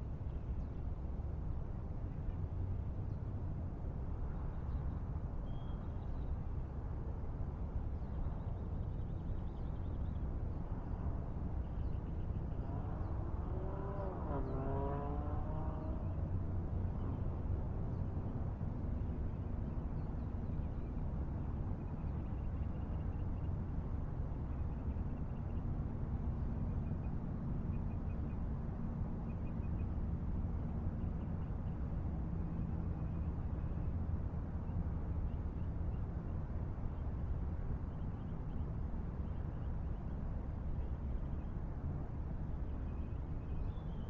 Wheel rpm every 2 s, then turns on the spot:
0, 0, 0, 0, 0, 0, 0, 0, 0, 0, 0, 0, 0, 0, 0, 0, 0, 0, 0, 0, 0, 0.
none